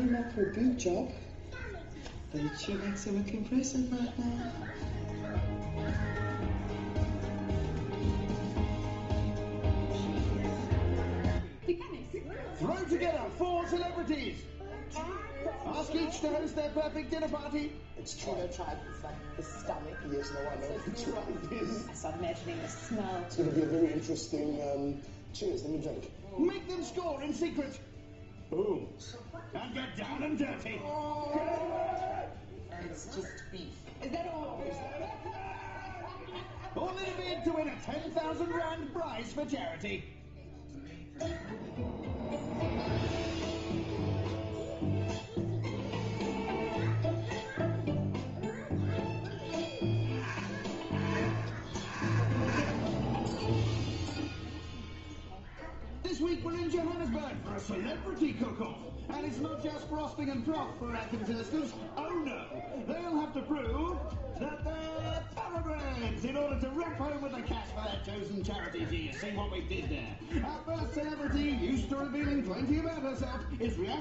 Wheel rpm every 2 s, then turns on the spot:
0, 0, 0, 0, 0, 0, 0, 0, 0, 0, 0, 0, 0, 0, 0, 0, 0, 0, 0, 0, 0, 0, 0, 0, 0, 0, 0, 0, 0, 0, 0, 0, 0, 0, 0, 0, 0.
none